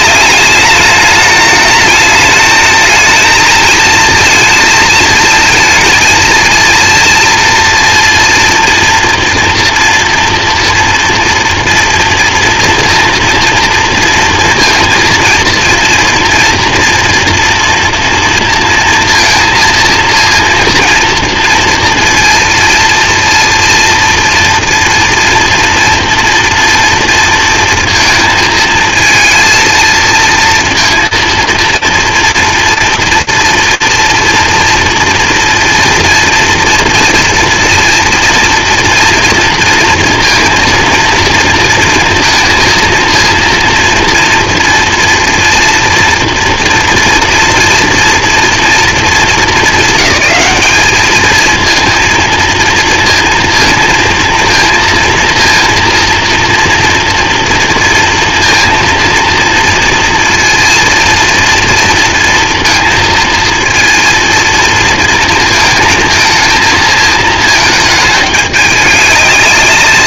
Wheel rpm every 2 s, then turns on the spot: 210, 220, 220, 230, 230, 230, 230, 230, 230, 230, 230, 230, 230, 230, 220, 230, 230, 230, 230, 230, 230, 230, 230, 230, 240, 210, 230, 230, 230, 230, 230, 230, 230, 220, 210.
none